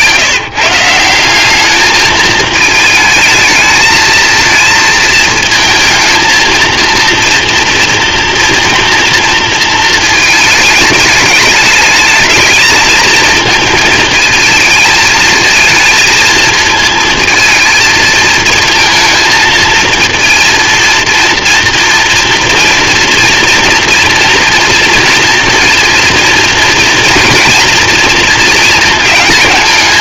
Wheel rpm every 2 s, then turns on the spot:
180, 220, 230, 230, 230, 220, 220, 220, 220, 220, 230, 230, 230, 230, 220.
none